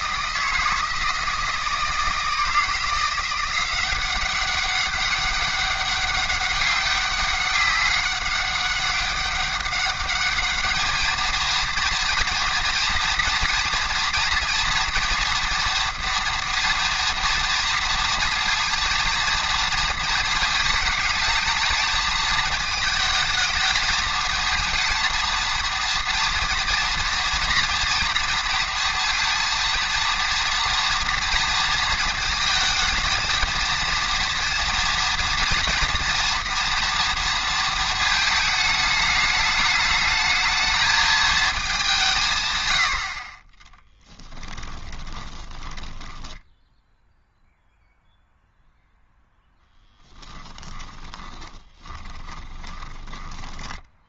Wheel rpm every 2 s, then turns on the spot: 160, 160, 190, 200, 200, 210, 230, 230, 230, 230, 220, 220, 230, 230, 230, 230, 220, 230, 230, 220, 220, 100, 20, 10, 0, 10, 20.
44-48 50-54